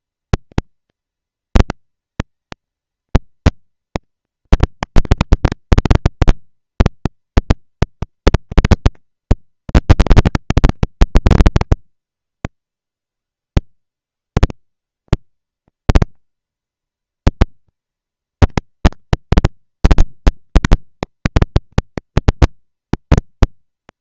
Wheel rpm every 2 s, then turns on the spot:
230, 230, 230, 230, 230, 220, 40, 120, 220, 230, 230, 230.
none